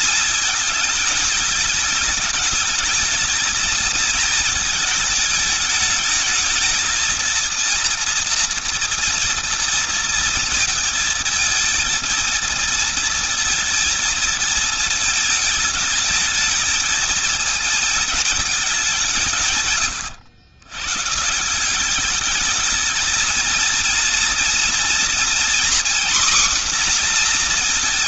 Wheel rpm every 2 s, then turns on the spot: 220, 220, 220, 220, 240, 220, 230, 220, 220, 180, 130, 220, 240, 250.
none